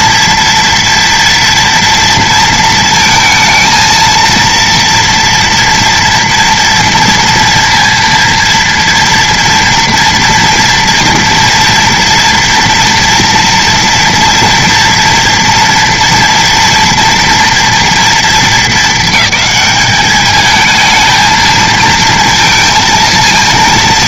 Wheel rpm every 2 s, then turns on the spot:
230, 230, 230, 230, 230, 240, 240, 230, 230, 220, 220, 230.
none